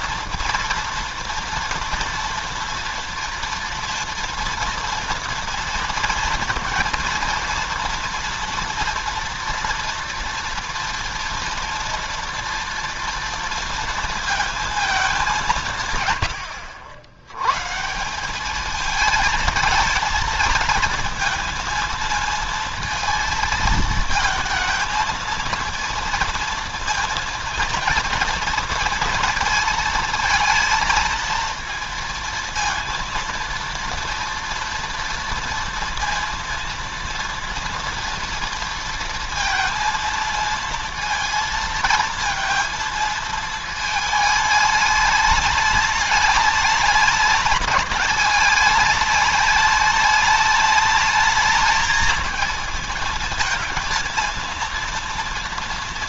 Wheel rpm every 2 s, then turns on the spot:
240, 230, 240, 230, 230, 230, 230, 230, 90, 200, 230, 230, 220, 230, 230, 220, 230, 230, 230, 230, 230, 230, 220, 210, 210, 210, 220, 230.
none